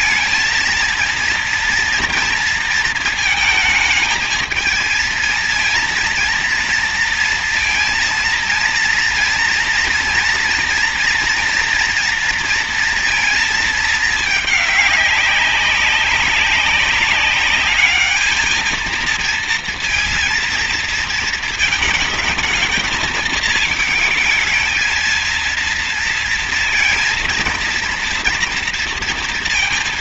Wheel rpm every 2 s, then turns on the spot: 230, 230, 220, 230, 230, 230, 230, 200, 200, 230, 230, 220, 220, 230, 230.
none